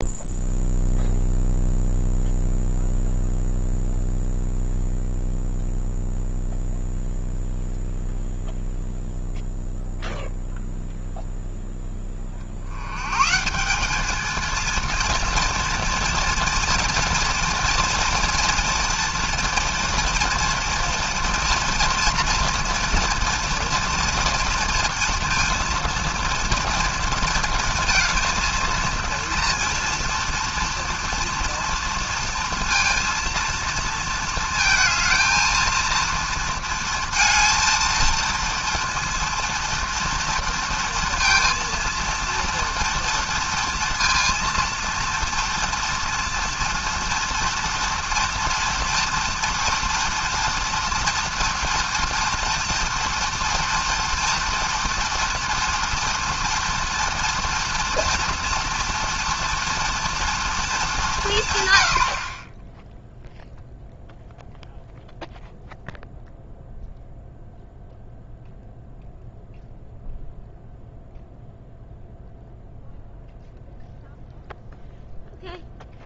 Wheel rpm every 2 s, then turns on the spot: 0, 0, 0, 0, 0, 0, 70, 230, 230, 230, 230, 230, 240, 230, 230, 230, 230, 220, 230, 230, 230, 230, 230, 230, 230, 230, 230, 230, 230, 230, 210, 10, 0, 0, 0, 0, 0, 0.
none